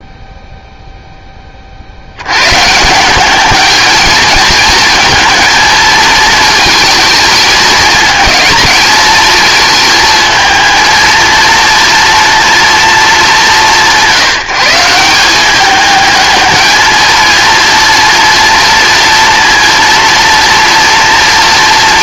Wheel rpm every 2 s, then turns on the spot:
0, 150, 220, 220, 220, 230, 230, 170, 220, 230, 230.
none